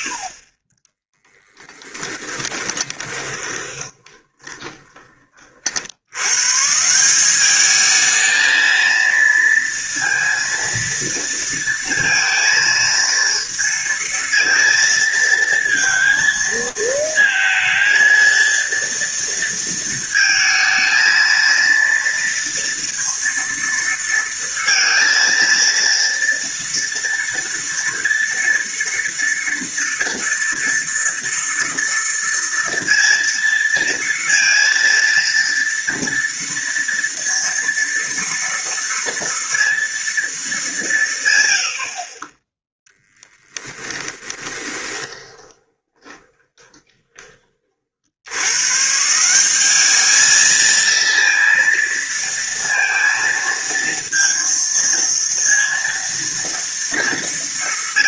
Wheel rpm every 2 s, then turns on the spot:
60, 20, 20, 140, 220, 230, 230, 230, 230, 230, 220, 230, 230, 230, 230, 230, 230, 230, 230, 230, 210, 10, 20, 20, 110, 220, 230, 230, 230.
2-6 44-48